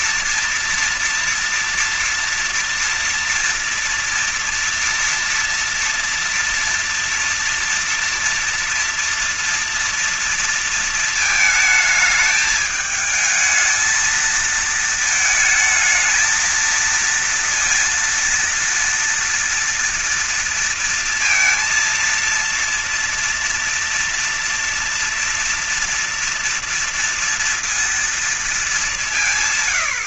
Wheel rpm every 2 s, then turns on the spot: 230, 230, 230, 230, 230, 230, 210, 220, 230, 230, 230, 230, 240, 230, 200.
none